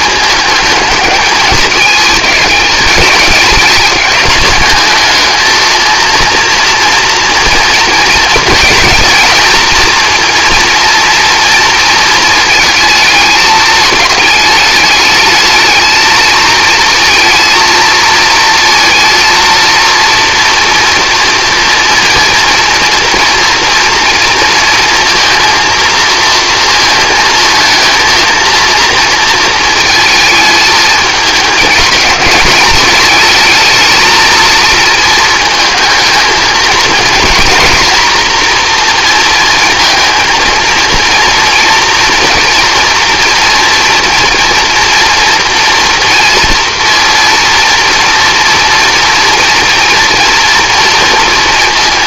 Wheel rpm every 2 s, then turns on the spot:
220, 220, 220, 230, 230, 230, 220, 210, 220, 230, 230, 240, 220, 230, 230, 220, 210, 230, 230, 240, 230, 230, 230, 240, 230, 230.
none